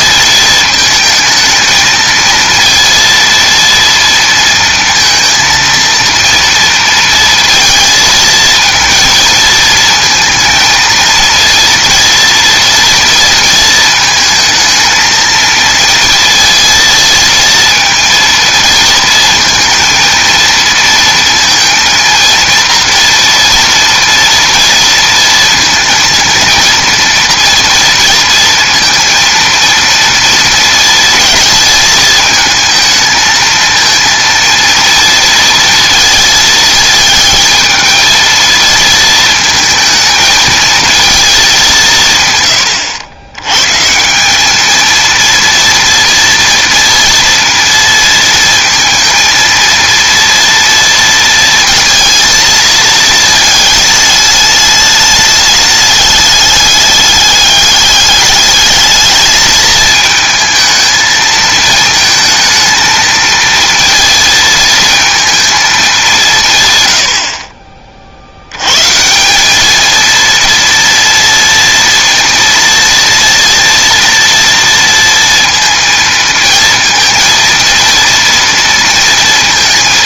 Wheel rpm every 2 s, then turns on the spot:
220, 230, 230, 230, 220, 230, 230, 220, 230, 230, 230, 230, 230, 230, 230, 230, 220, 230, 220, 230, 220, 110, 220, 230, 230, 230, 220, 210, 200, 210, 220, 220, 230, 120, 120, 230, 230, 230, 220, 230.
none